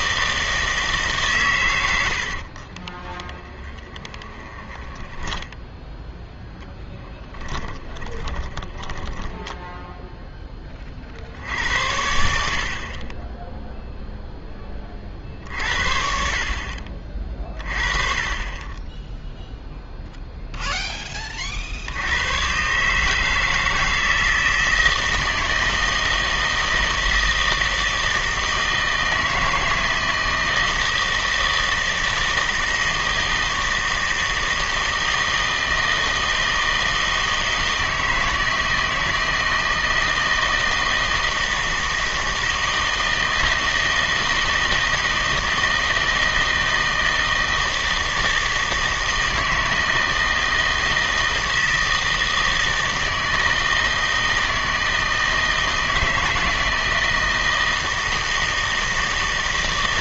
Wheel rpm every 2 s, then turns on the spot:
160, 50, 20, 10, 20, 20, 50, 10, 50, 20, 0, 130, 160, 160, 160, 160, 160, 160, 160, 160, 160, 160, 160, 160, 160, 160, 160, 160, 160, 160.
2-10